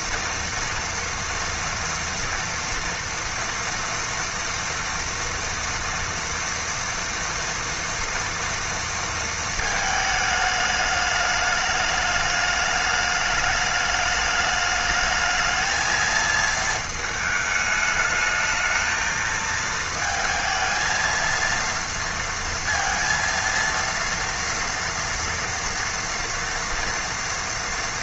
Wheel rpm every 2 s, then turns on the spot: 230, 230, 230, 230, 230, 210, 210, 210, 220, 220, 220, 230, 230, 230.
none